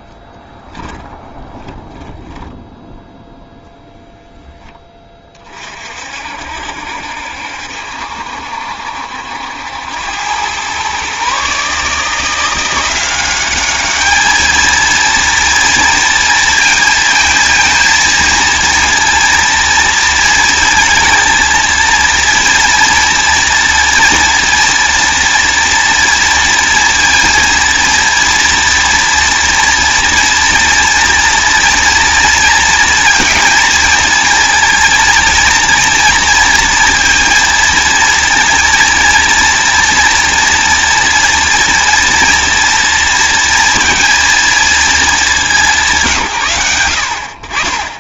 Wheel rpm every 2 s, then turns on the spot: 10, 0, 10, 60, 70, 110, 170, 220, 230, 230, 230, 230, 230, 230, 230, 240, 230, 230, 230, 230, 230, 230, 220, 100.
none